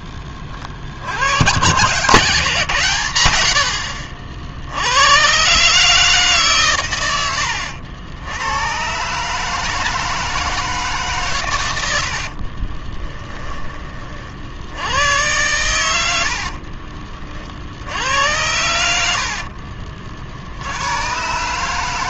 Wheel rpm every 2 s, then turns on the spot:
40, 140, 70, 130, 110, 160, 40, 70, 50, 100, 80.
12-14 16-18